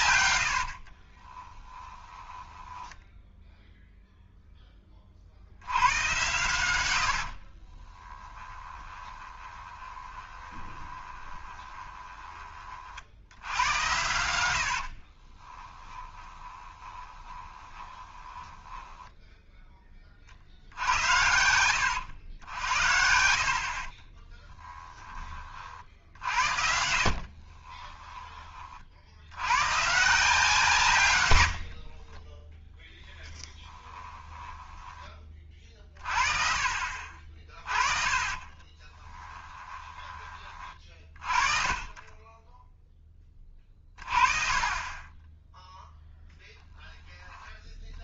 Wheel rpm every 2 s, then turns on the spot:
70, 10, 10, 100, 10, 20, 40, 80, 20, 10, 70, 70, 10, 60, 30, 150, 10, 10, 40, 30, 30, 0, 30, 10.
0-4 8-12 14-20 22-28 32-36 38-42